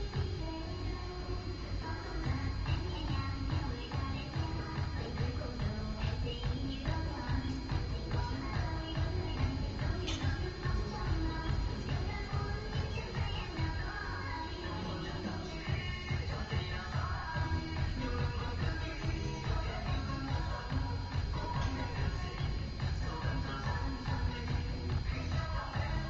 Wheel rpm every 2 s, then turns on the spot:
0, 0, 0, 0, 0, 0, 0, 0, 0, 0, 0, 0, 0.
none